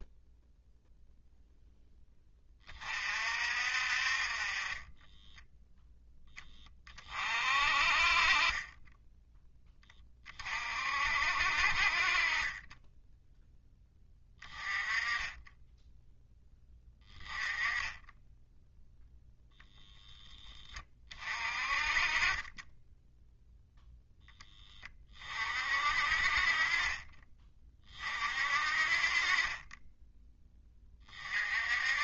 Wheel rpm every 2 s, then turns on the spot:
0, 30, 30, 20, 20, 40, 20, 20, 20, 0, 20, 10, 10, 30, 40, 20.
none